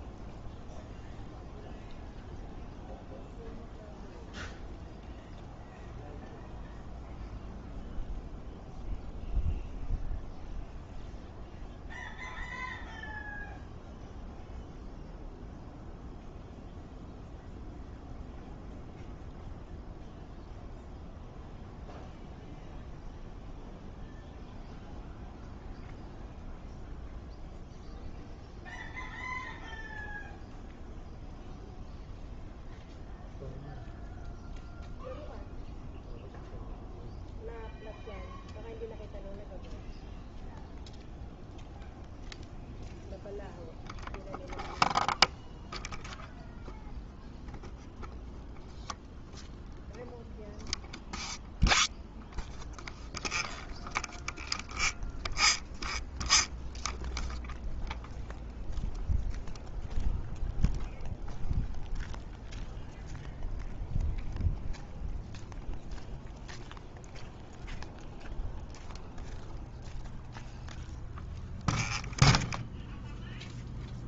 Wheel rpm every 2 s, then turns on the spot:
0, 0, 0, 0, 0, 0, 0, 0, 0, 0, 0, 0, 0, 0, 0, 0, 0, 0, 0, 0, 0, 0, 0, 0, 0, 0, 0, 0, 0, 0, 0, 0, 0, 0, 0, 0, 0.
none